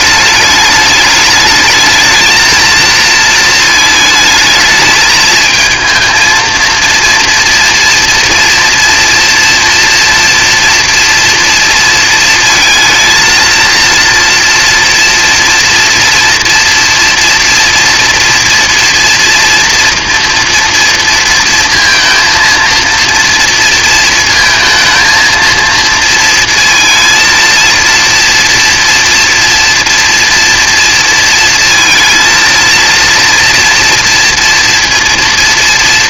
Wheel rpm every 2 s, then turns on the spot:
210, 220, 220, 230, 240, 230, 220, 240, 240, 230, 230, 230, 230, 230, 230, 230, 230, 230.
none